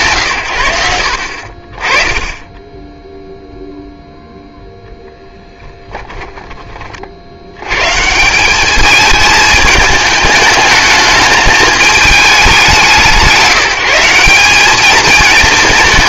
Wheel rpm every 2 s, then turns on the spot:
90, 20, 0, 30, 200, 210, 180, 210.
none